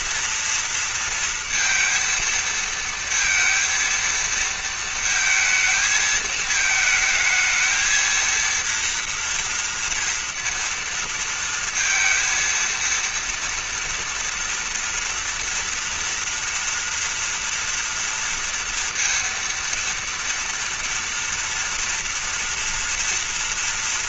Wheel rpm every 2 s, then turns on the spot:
230, 230, 230, 220, 230, 230, 230, 230, 230, 230, 230, 230.
none